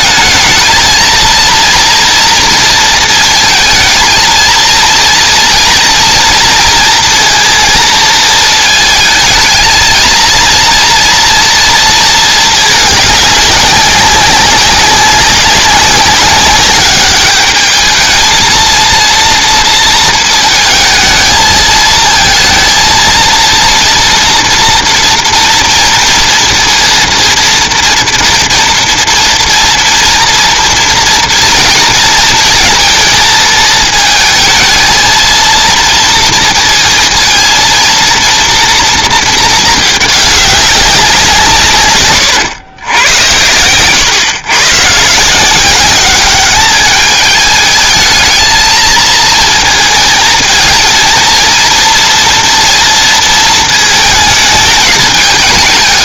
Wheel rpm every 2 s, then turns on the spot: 220, 230, 230, 230, 220, 230, 220, 190, 200, 230, 220, 230, 230, 230, 230, 230, 230, 220, 230, 230, 200, 120, 120, 200, 220, 230, 230, 210.
none